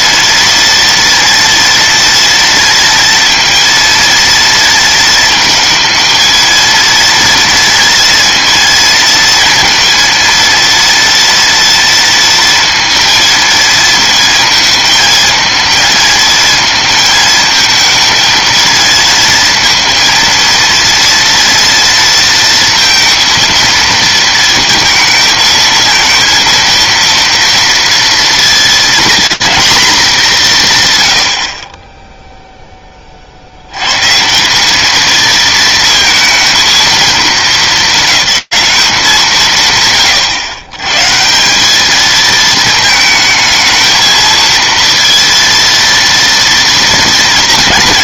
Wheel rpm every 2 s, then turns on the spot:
230, 230, 230, 230, 230, 230, 230, 220, 220, 230, 230, 230, 230, 230, 230, 170, 0, 180, 230, 200, 130, 210, 220, 230.
none